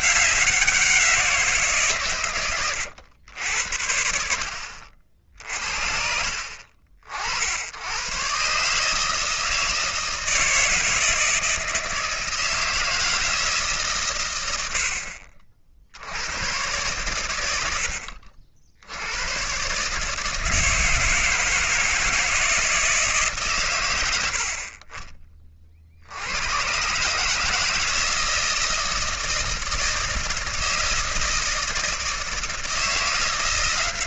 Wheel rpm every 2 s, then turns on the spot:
180, 110, 60, 60, 140, 160, 160, 80, 110, 70, 160, 160, 50, 130, 160, 160, 160.
none